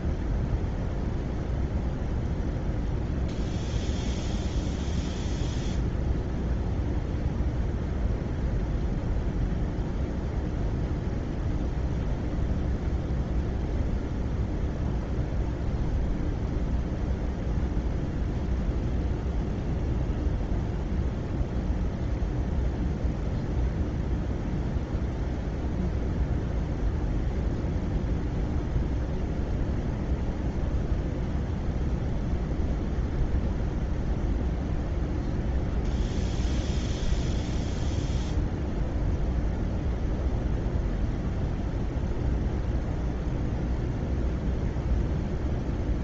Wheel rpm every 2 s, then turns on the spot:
0, 0, 0, 0, 0, 0, 0, 0, 0, 0, 0, 0, 0, 0, 0, 0, 0, 0, 0, 0, 0, 0, 0.
none